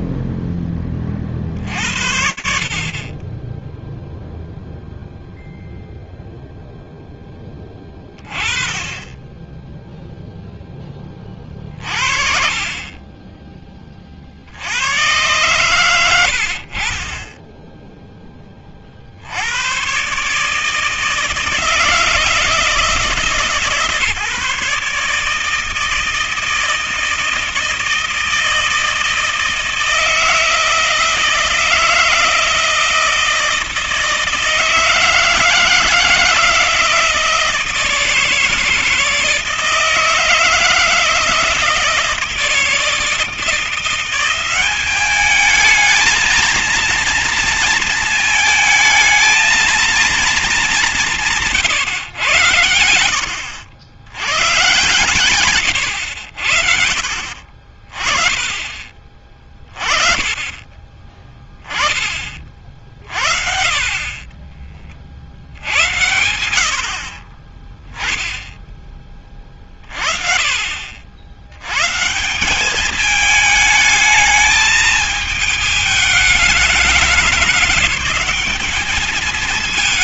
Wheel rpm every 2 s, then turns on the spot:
0, 40, 20, 0, 30, 20, 30, 110, 30, 80, 160, 150, 160, 160, 170, 160, 160, 150, 160, 160, 160, 170, 210, 230, 220, 150, 70, 120, 60, 30, 20, 50, 50, 70, 20, 50, 200, 220, 200, 210.
54-56